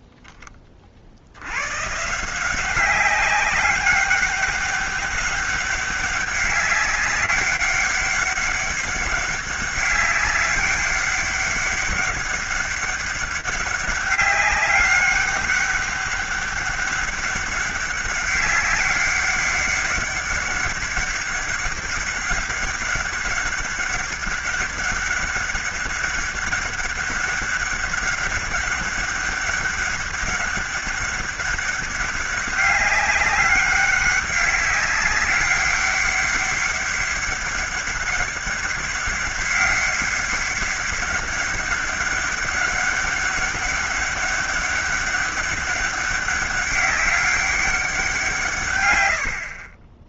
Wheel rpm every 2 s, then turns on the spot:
10, 180, 200, 200, 200, 200, 200, 200, 200, 200, 200, 200, 200, 200, 200, 200, 200, 190, 200, 200, 200, 200, 200, 200, 130.
none